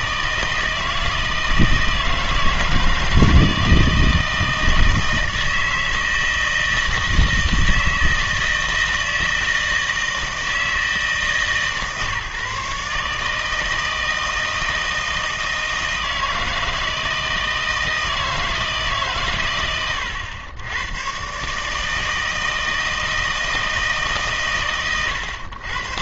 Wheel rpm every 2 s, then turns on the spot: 160, 160, 160, 160, 160, 160, 150, 160, 160, 150, 100, 160, 120.
none